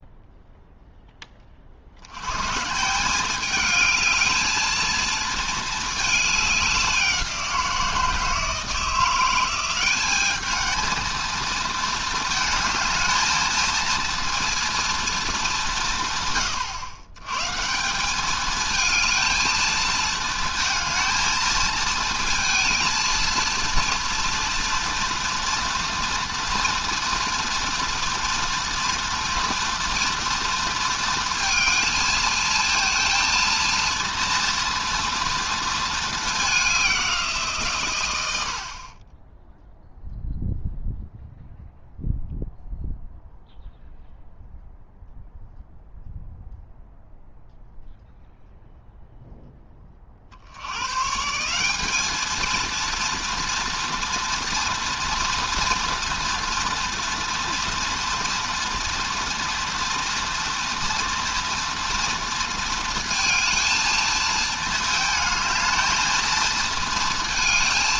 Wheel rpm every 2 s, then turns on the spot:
0, 150, 220, 200, 170, 220, 220, 230, 130, 220, 230, 230, 230, 240, 240, 230, 220, 230, 210, 70, 0, 0, 0, 0, 0, 80, 220, 230, 230, 230, 230, 230, 220, 220.
none